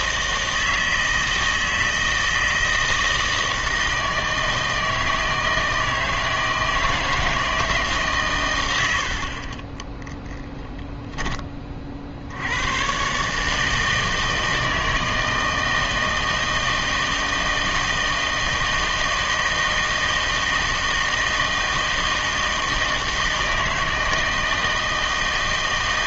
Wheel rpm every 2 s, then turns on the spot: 160, 160, 160, 160, 90, 0, 110, 160, 160, 160, 160, 160, 160.
none